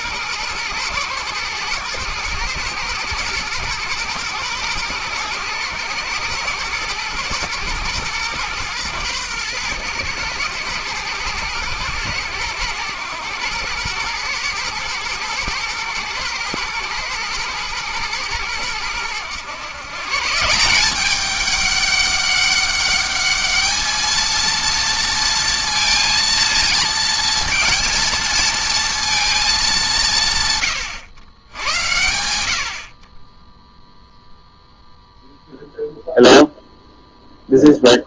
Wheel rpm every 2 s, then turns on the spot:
120, 110, 110, 110, 110, 110, 110, 120, 120, 110, 180, 200, 230, 230, 230, 130, 60, 0, 0.
none